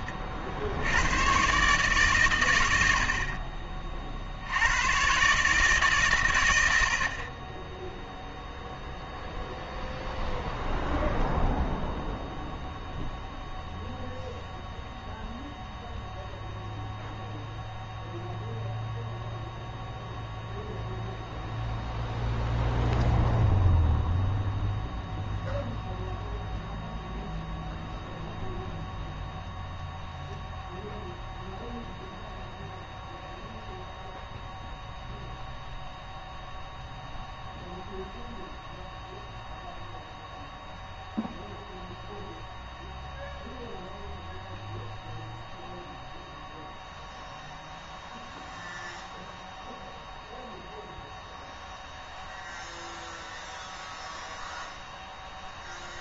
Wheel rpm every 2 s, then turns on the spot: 90, 70, 100, 70, 0, 0, 0, 0, 0, 0, 0, 0, 0, 0, 0, 0, 0, 0, 0, 0, 0, 0, 0, 0, 0, 0, 0, 0.
none